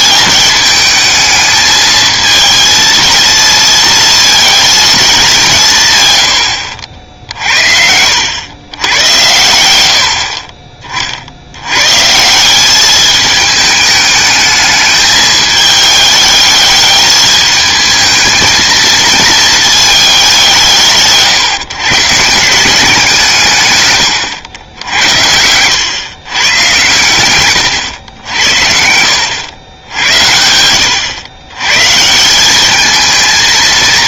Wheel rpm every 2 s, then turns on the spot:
210, 230, 220, 80, 100, 40, 200, 210, 210, 220, 170, 170, 80, 130, 70, 90, 200.
none